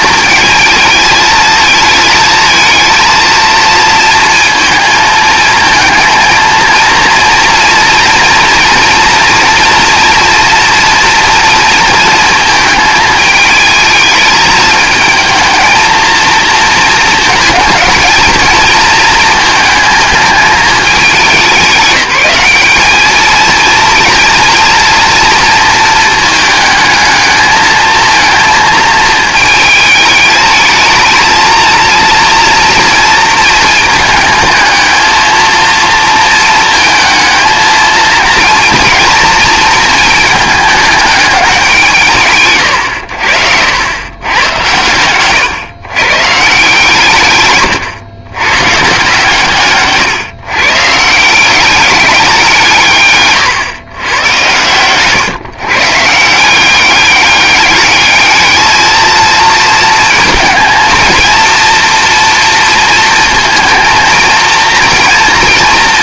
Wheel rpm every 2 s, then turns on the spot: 230, 220, 220, 230, 230, 230, 220, 220, 230, 220, 210, 210, 230, 220, 220, 220, 230, 220, 220, 230, 210, 100, 110, 150, 130, 140, 160, 120, 190, 220, 230, 230, 230.
none